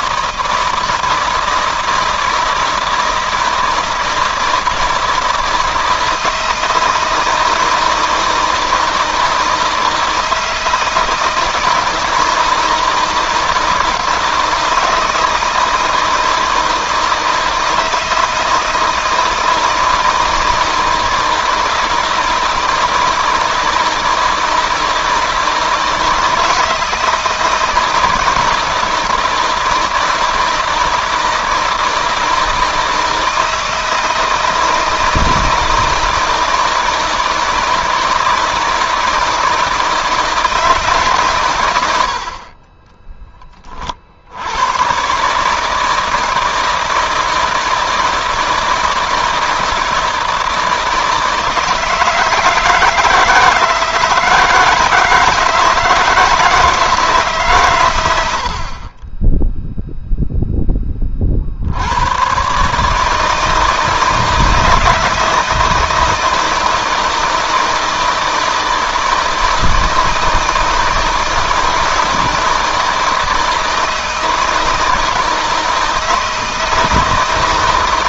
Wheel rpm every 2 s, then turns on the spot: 160, 160, 160, 160, 160, 160, 160, 160, 160, 160, 160, 160, 160, 160, 160, 160, 160, 160, 160, 160, 140, 10, 120, 160, 160, 160, 160, 160, 160, 20, 30, 150, 160, 160, 160, 160, 160, 160, 160.
42-44